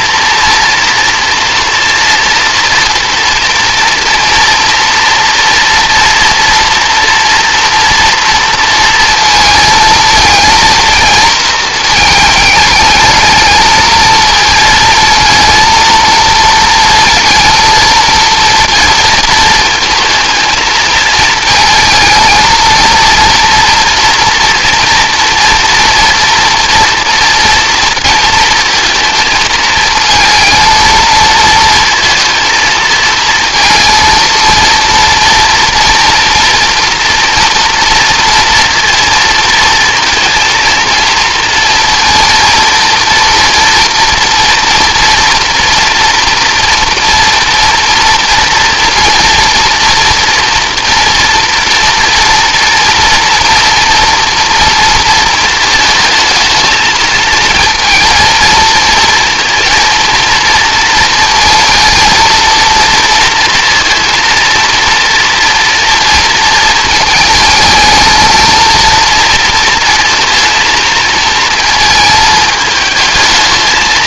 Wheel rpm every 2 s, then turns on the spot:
230, 230, 240, 230, 230, 230, 210, 230, 230, 230, 220, 230, 230, 230, 220, 220, 230, 230, 230, 230, 230, 230, 230, 240, 230, 240, 240, 230, 220, 220, 230, 230, 230, 220, 230, 230, 220.
none